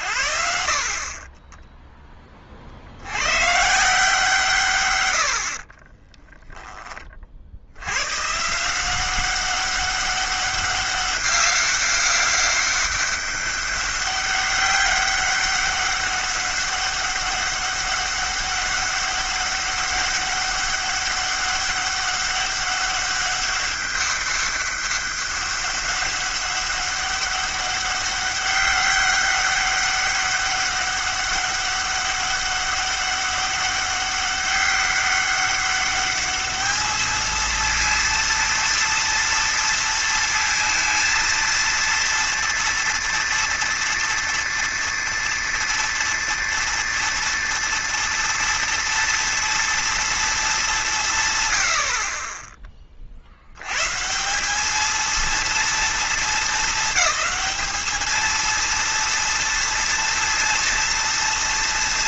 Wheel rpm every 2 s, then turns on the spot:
30, 120, 70, 30, 190, 200, 200, 200, 200, 200, 200, 200, 200, 200, 200, 200, 200, 200, 220, 230, 230, 230, 230, 230, 230, 180, 40, 210, 210, 230, 230.
none